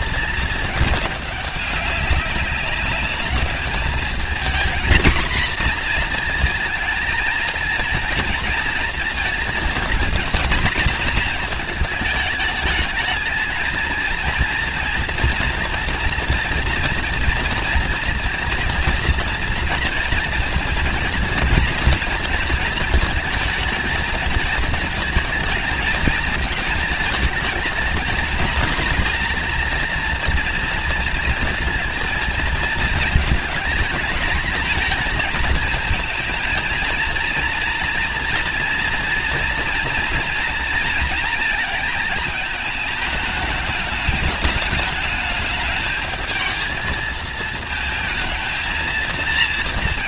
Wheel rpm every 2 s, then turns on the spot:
220, 200, 240, 230, 220, 230, 210, 230, 230, 230, 230, 230, 220, 220, 220, 230, 220, 220, 230, 230, 230, 220, 210, 220, 230.
none